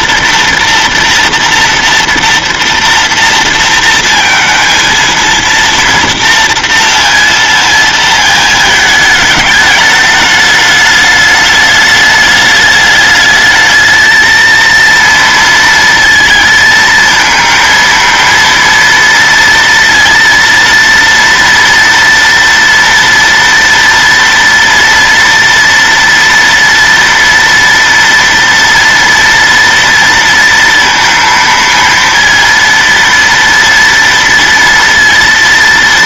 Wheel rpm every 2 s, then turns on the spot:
230, 230, 230, 230, 220, 210, 210, 230, 230, 230, 230, 230, 230, 230, 230, 230, 230, 230.
none